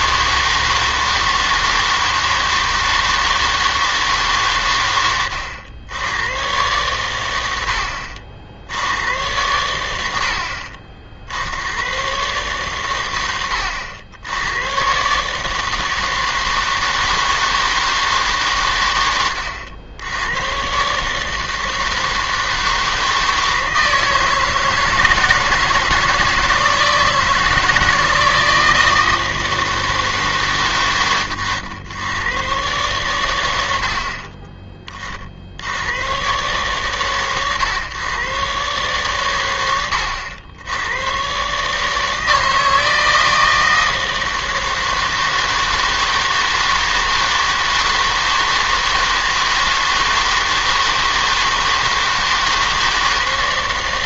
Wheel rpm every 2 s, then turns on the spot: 160, 160, 90, 100, 90, 50, 120, 120, 160, 120, 130, 160, 160, 160, 160, 120, 120, 30, 130, 130, 90, 160, 160, 160, 160, 160, 160.
none